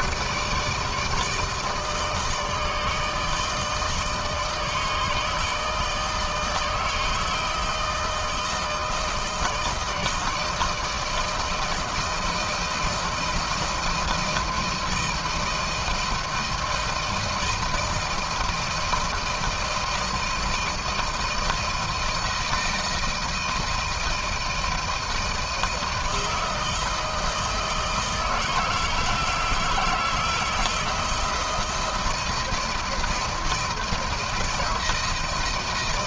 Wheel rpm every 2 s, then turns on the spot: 160, 160, 150, 160, 160, 160, 170, 160, 160, 160, 160, 170, 160, 160, 160, 160, 170, 170.
none